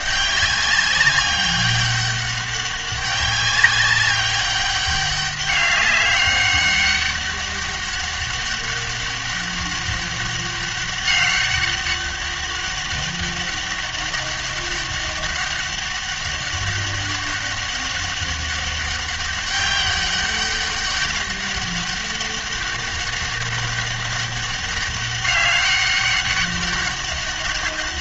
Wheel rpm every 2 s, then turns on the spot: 200, 200, 200, 200, 200, 200, 200, 200, 200, 200, 200, 200, 200, 200.
none